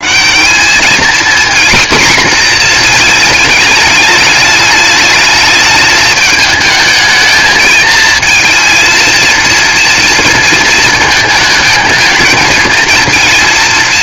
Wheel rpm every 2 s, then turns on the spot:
220, 230, 210, 220, 230, 220, 220.
none